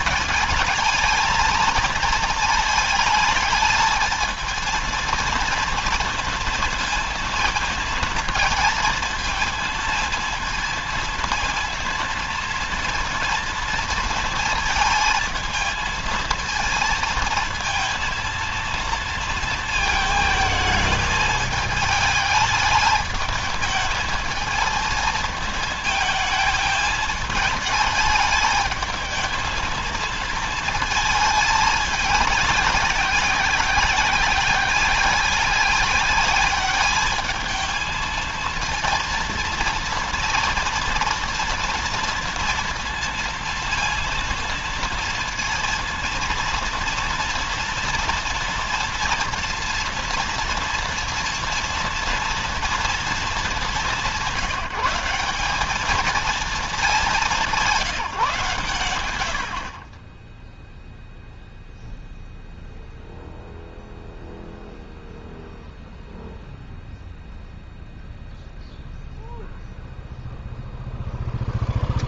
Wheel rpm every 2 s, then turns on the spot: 220, 220, 230, 230, 220, 230, 230, 220, 220, 230, 220, 210, 220, 220, 220, 220, 190, 190, 210, 230, 240, 230, 230, 230, 230, 230, 230, 190, 210, 120, 0, 0, 0, 0, 0, 0.
none